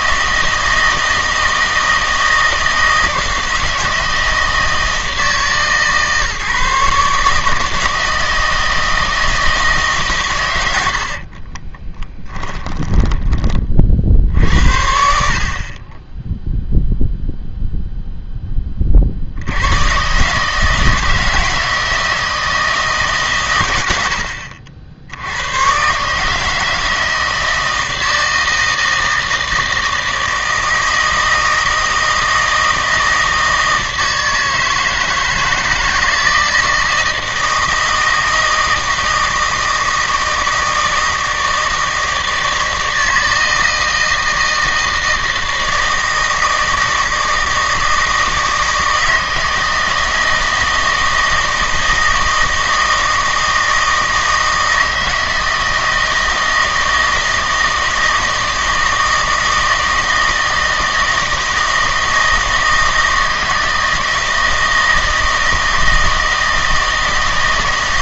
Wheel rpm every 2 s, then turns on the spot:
160, 160, 160, 150, 160, 90, 10, 70, 0, 20, 160, 160, 60, 160, 160, 160, 160, 160, 160, 160, 160, 160, 160, 160, 160, 160, 160, 160, 160, 160, 160, 160, 160, 160.
10-14